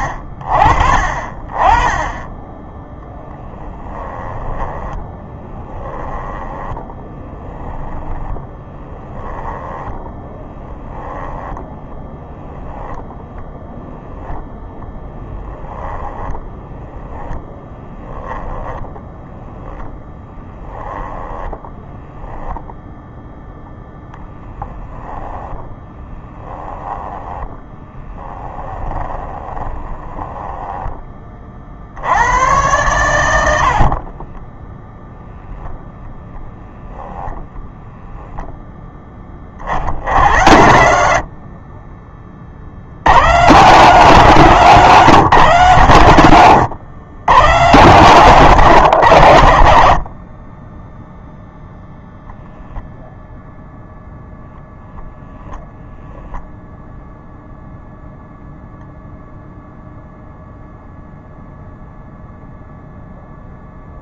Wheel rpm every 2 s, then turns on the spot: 40, 10, 10, 10, 10, 10, 0, 10, 10, 10, 10, 0, 10, 10, 20, 10, 100, 0, 0, 10, 80, 90, 160, 100, 140, 10, 0, 0, 0, 0, 0, 0.
4-12 16-22 24-30